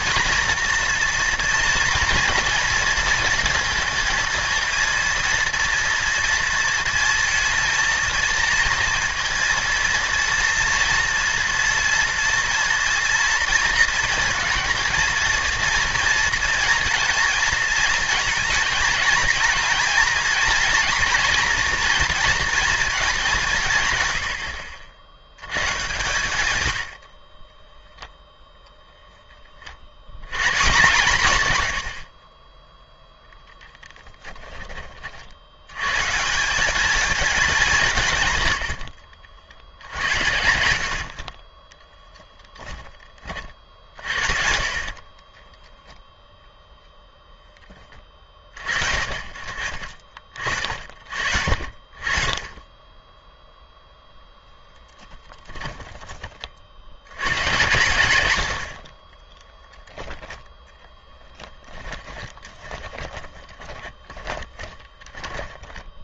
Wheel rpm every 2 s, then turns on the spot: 230, 230, 230, 230, 230, 240, 230, 230, 230, 230, 230, 210, 70, 70, 0, 140, 10, 20, 200, 90, 80, 10, 60, 0, 40, 50, 20, 20, 40, 90, 10, 20, 30.
44-46 54-56 60-66